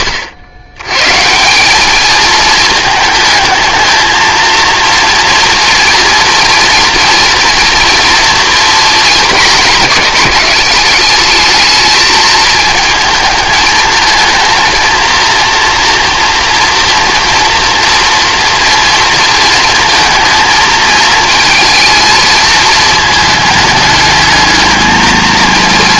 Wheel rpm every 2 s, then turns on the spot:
110, 220, 230, 230, 230, 200, 220, 230, 230, 230, 220, 220, 220.
none